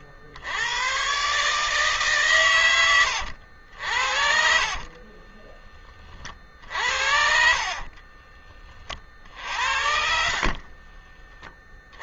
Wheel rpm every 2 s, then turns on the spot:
80, 140, 50, 50, 30, 40.
4-8 10-12